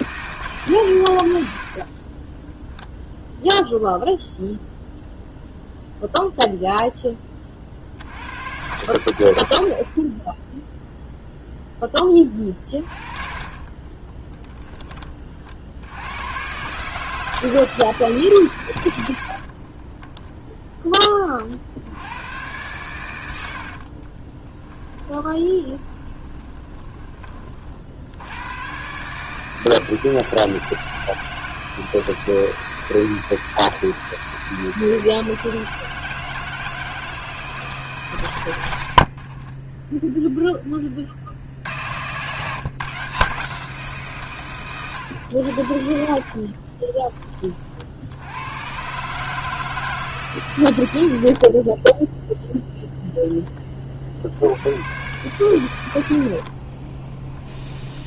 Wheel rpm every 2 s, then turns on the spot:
150, 20, 0, 0, 90, 10, 30, 10, 130, 110, 0, 110, 20, 20, 110, 160, 160, 160, 160, 90, 10, 140, 120, 40, 90, 110, 0, 90, 50.
2-4 12-14 24-28 46-48 56-58